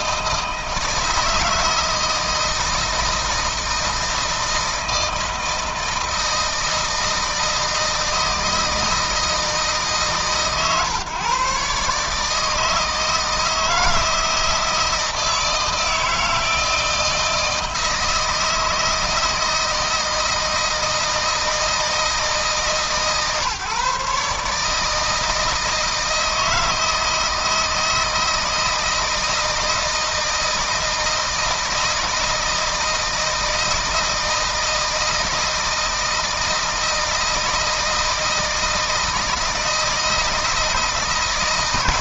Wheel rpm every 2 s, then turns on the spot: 160, 160, 160, 160, 160, 130, 160, 160, 160, 160, 160, 140, 150, 160, 160, 160, 160, 160, 160, 160, 160.
none